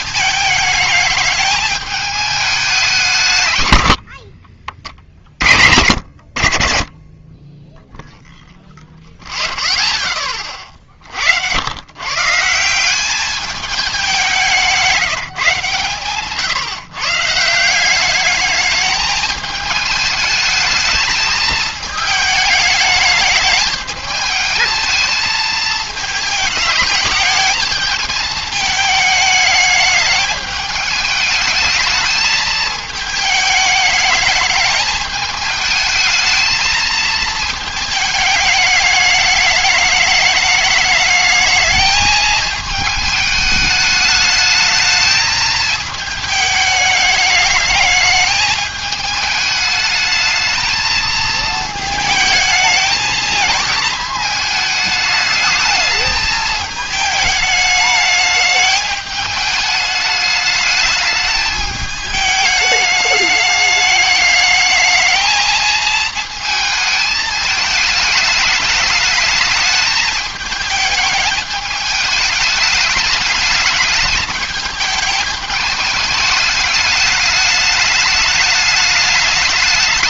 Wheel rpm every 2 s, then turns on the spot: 220, 200, 40, 70, 0, 40, 160, 180, 150, 210, 210, 210, 220, 210, 210, 210, 220, 220, 220, 210, 210, 220, 210, 210, 210, 220, 220, 220, 220, 210, 210, 210, 210, 220, 210, 210, 210, 210, 210, 210.
none